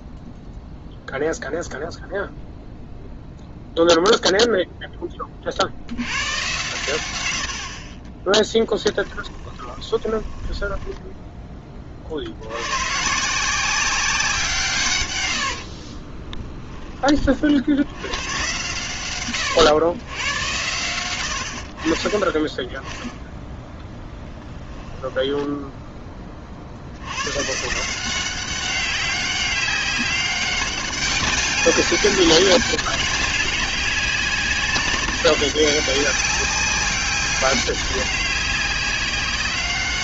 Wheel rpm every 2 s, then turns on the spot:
0, 0, 0, 110, 10, 20, 100, 150, 20, 120, 100, 10, 10, 60, 190, 190, 200, 190, 200, 190.
8-12 24-26